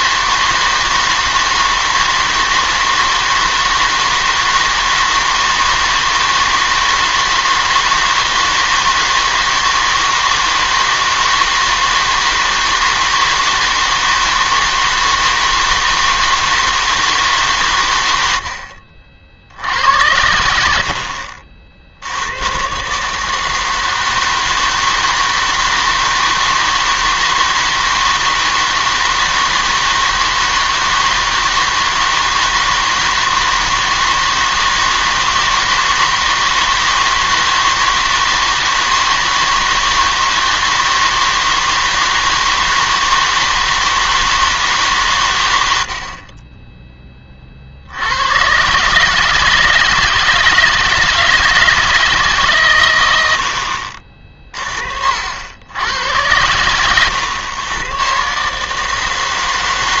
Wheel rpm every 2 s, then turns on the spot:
160, 160, 160, 160, 160, 160, 160, 160, 160, 70, 70, 140, 160, 160, 160, 160, 160, 160, 160, 160, 160, 160, 140, 20, 150, 170, 110, 50, 120, 160.
56-58